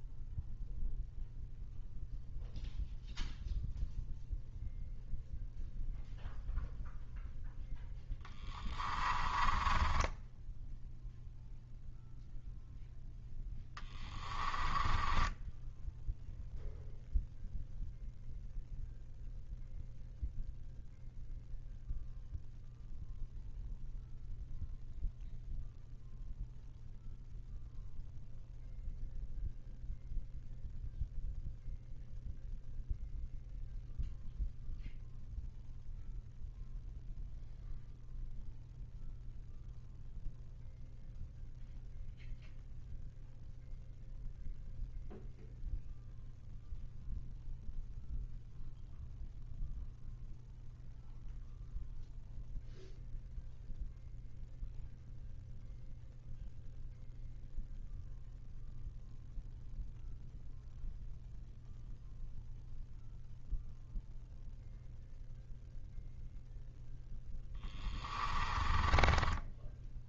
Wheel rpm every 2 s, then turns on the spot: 0, 0, 0, 0, 20, 0, 0, 20, 0, 0, 0, 0, 0, 0, 0, 0, 0, 0, 0, 0, 0, 0, 0, 0, 0, 0, 0, 0, 0, 0, 0, 0, 0, 0, 20.
8-10 14-16 68-70